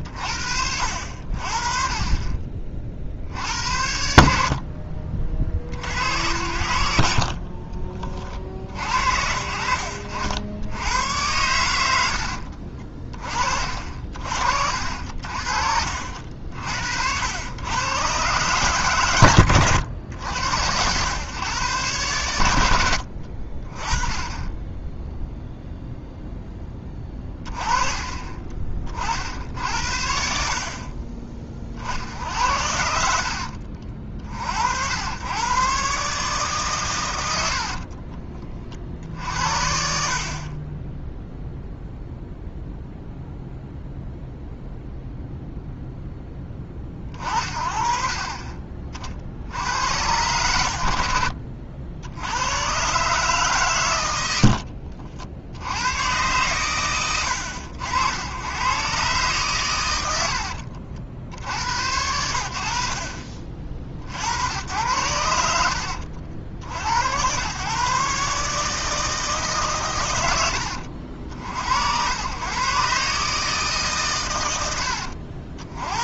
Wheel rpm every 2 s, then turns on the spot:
60, 40, 40, 80, 60, 90, 40, 70, 60, 120, 90, 90, 10, 10, 40, 40, 70, 80, 130, 40, 20, 0, 0, 30, 30, 80, 120, 60, 110, 120, 60, 60, 90, 80, 150, 70, 130, 80.
54-56